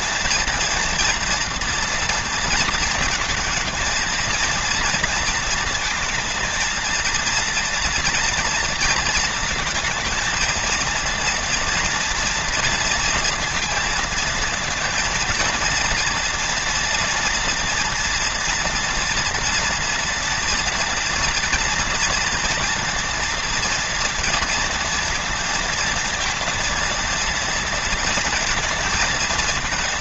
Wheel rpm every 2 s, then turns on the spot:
240, 230, 230, 230, 230, 230, 230, 230, 230, 230, 230, 230, 230, 230, 230.
none